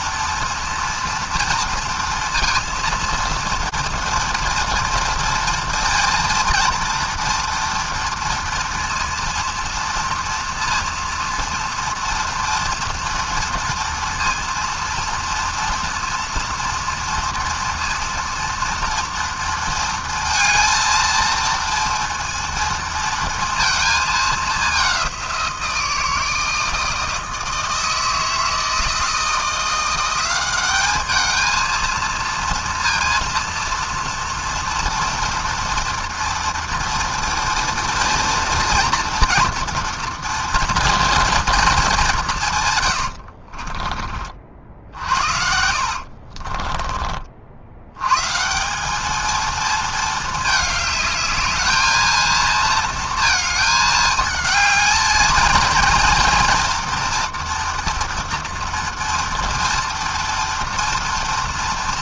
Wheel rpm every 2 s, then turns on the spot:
230, 230, 230, 230, 230, 230, 240, 230, 230, 230, 230, 230, 200, 160, 160, 190, 230, 230, 230, 230, 230, 140, 50, 30, 170, 220, 230, 220, 230, 230, 230.
42-44 46-48